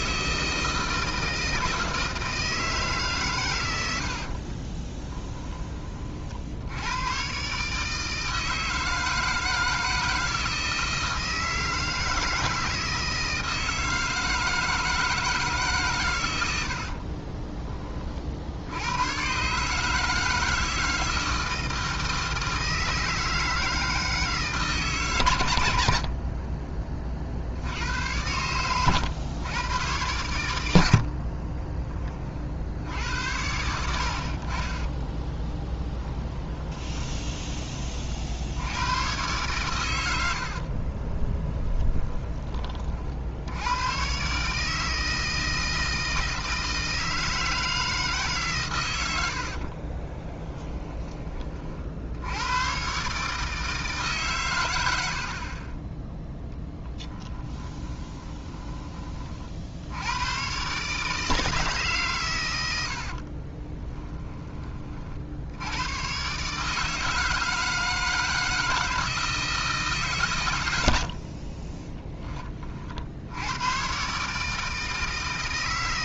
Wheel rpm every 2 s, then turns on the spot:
160, 150, 20, 100, 160, 160, 160, 160, 50, 100, 160, 160, 140, 30, 110, 70, 80, 30, 20, 100, 40, 50, 160, 160, 110, 20, 130, 100, 10, 20, 140, 80, 40, 160, 160, 90, 50, 160.
4-6 16-18 30-32 36-38 40-42 50-52 54-58 62-64